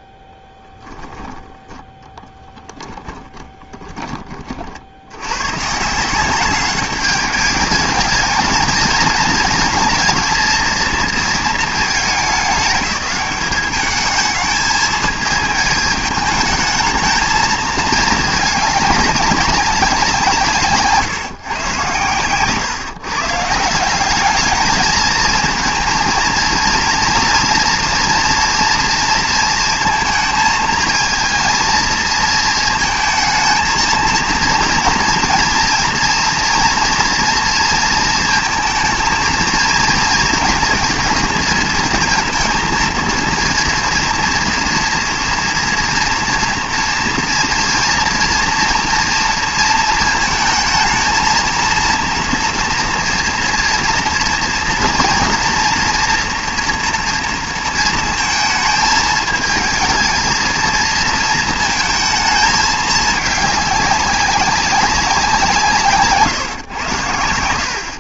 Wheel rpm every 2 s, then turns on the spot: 10, 10, 60, 200, 220, 230, 190, 220, 220, 220, 150, 140, 220, 230, 230, 220, 230, 230, 230, 230, 230, 230, 230, 230, 230, 220, 230, 240, 230, 220, 220, 220, 190, 120.
2-4